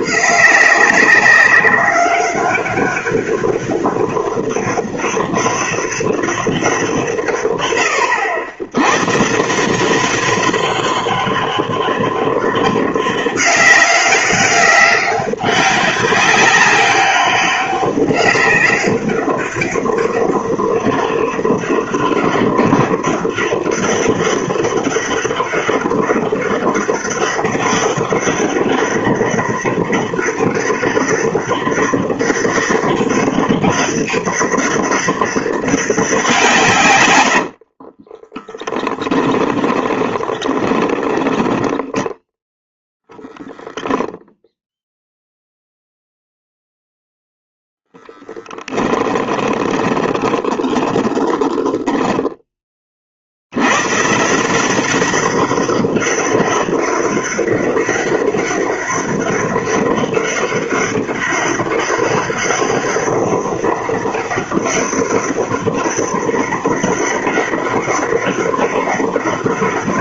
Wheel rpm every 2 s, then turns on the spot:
190, 200, 200, 190, 90, 200, 200, 190, 200, 200, 200, 200, 200, 200, 200, 200, 200, 200, 160, 10, 20, 10, 0, 0, 10, 10, 20, 170, 200, 200, 200, 200, 200, 200, 200.
38-42 48-52